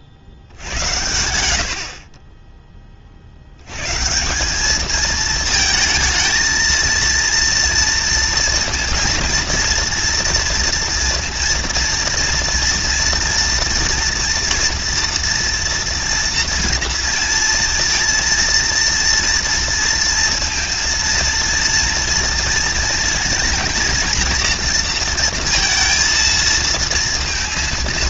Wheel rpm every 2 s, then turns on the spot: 60, 20, 200, 230, 230, 230, 230, 230, 230, 230, 230, 230, 230, 230.
none